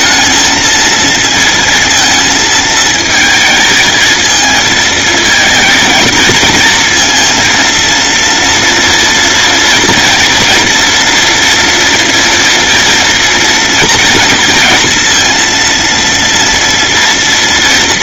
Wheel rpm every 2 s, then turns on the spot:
230, 220, 220, 230, 230, 230, 230, 230, 230.
none